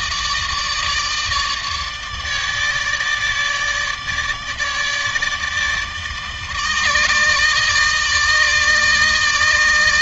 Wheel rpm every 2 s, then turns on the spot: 150, 150, 160, 150, 160.
none